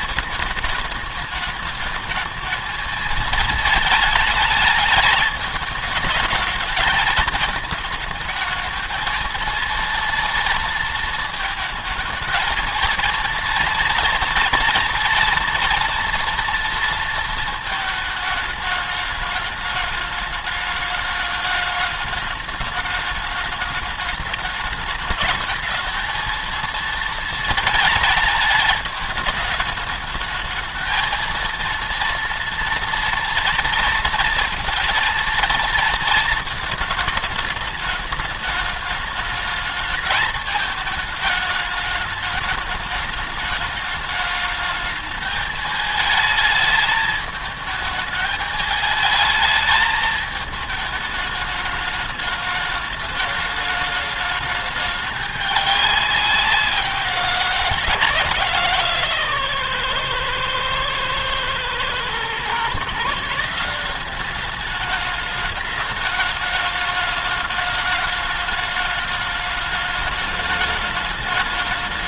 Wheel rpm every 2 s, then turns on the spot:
220, 220, 220, 220, 220, 230, 230, 240, 230, 220, 210, 210, 210, 220, 220, 220, 230, 230, 220, 210, 220, 210, 210, 220, 210, 220, 210, 210, 190, 160, 120, 130, 200, 210, 210, 210.
none